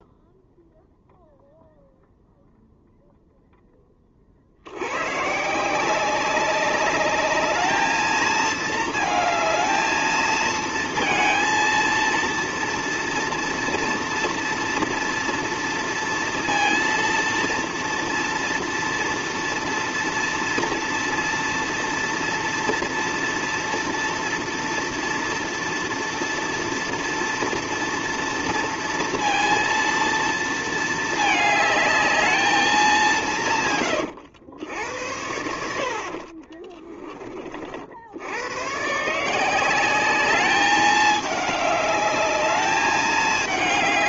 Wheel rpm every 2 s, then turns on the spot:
0, 0, 80, 200, 220, 220, 230, 230, 230, 230, 230, 230, 230, 230, 230, 220, 210, 80, 20, 120, 210, 210.
36-38